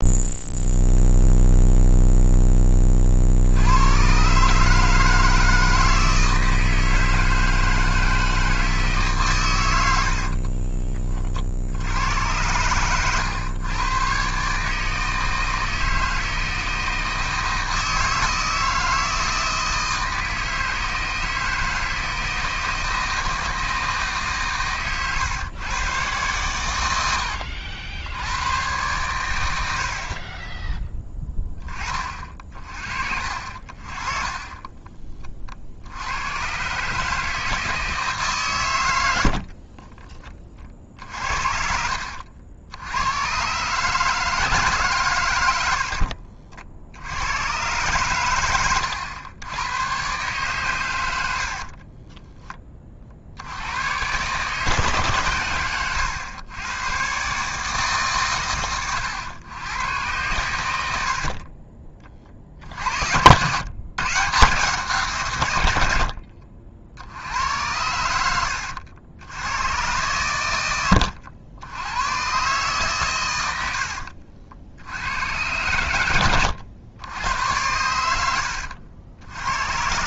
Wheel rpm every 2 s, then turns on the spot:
0, 10, 140, 160, 160, 30, 100, 140, 160, 160, 160, 160, 140, 100, 110, 20, 40, 20, 130, 130, 40, 70, 150, 60, 100, 120, 20, 140, 110, 120, 110, 50, 150, 60, 80, 100, 130, 70, 90, 80.
10-12 40-42 78-80